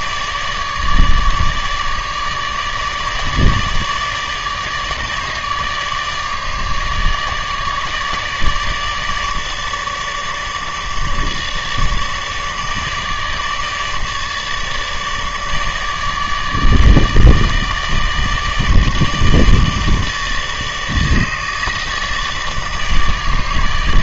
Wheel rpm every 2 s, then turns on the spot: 150, 150, 150, 150, 150, 150, 150, 150, 150, 160, 150, 150.
none